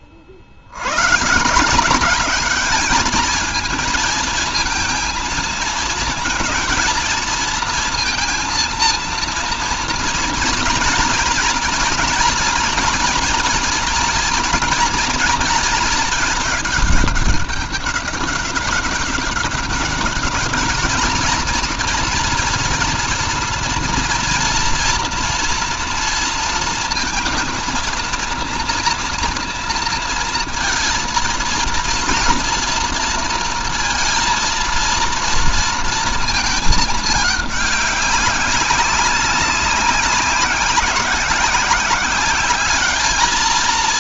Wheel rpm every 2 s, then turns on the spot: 60, 200, 230, 230, 230, 230, 230, 230, 210, 200, 210, 240, 230, 230, 230, 230, 230, 230, 220, 200, 190, 200.
none